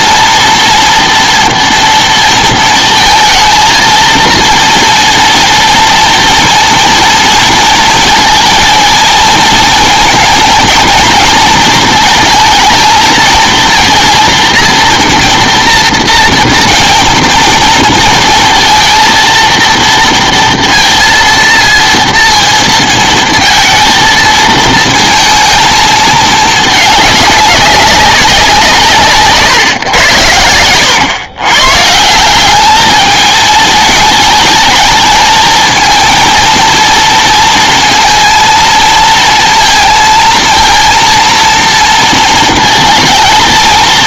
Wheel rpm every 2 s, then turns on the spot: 240, 230, 230, 230, 230, 230, 220, 230, 230, 230, 230, 230, 230, 210, 170, 100, 210, 220, 230, 230, 230, 230.
none